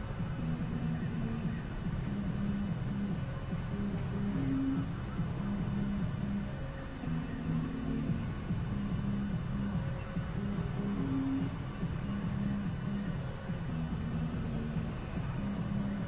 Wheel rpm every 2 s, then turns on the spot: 0, 0, 0, 0, 0, 0, 0, 0.
none